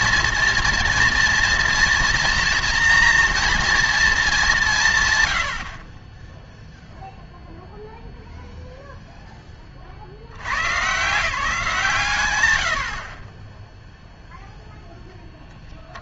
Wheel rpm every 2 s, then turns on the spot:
230, 230, 190, 0, 0, 110, 90, 0.
none